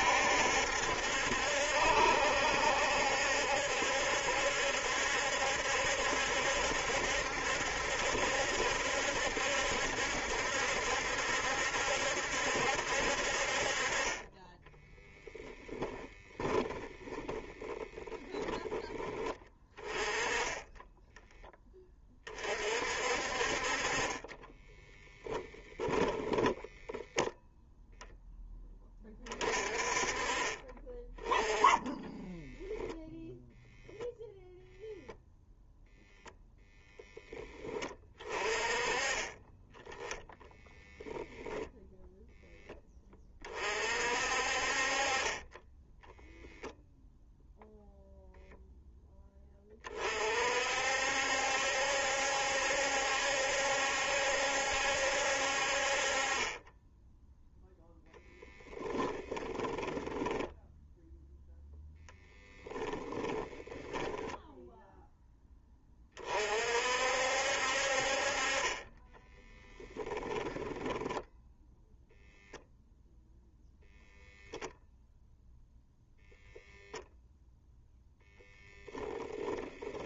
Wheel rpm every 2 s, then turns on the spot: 70, 70, 70, 70, 70, 70, 70, 10, 10, 10, 10, 50, 10, 0, 20, 20, 0, 0, 0, 30, 0, 20, 40, 0, 0, 60, 70, 70, 10, 10, 0, 10, 0, 60, 20, 0, 0, 0, 0, 10.
14-16 24-26 58-60 62-64